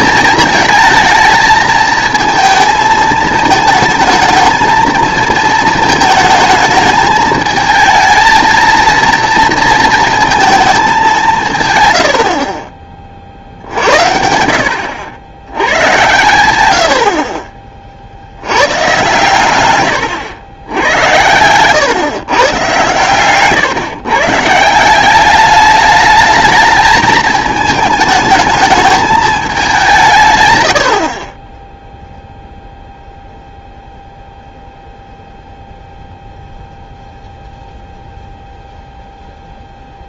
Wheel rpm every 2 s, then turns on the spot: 230, 220, 220, 220, 230, 220, 40, 80, 90, 120, 90, 130, 160, 210, 210, 100, 0, 0, 0, 0.
none